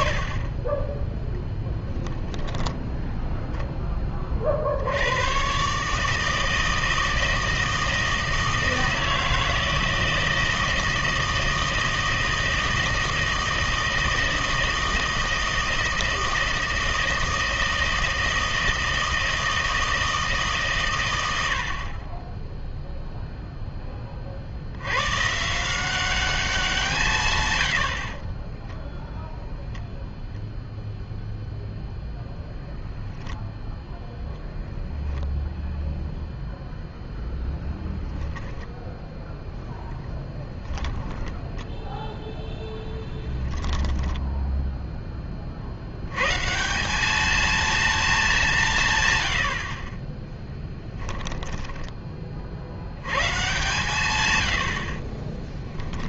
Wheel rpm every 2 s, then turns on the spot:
20, 10, 60, 160, 160, 160, 160, 160, 160, 160, 140, 0, 80, 180, 10, 0, 0, 0, 0, 0, 10, 10, 0, 170, 170, 10, 80, 70.
28-30 40-44 50-52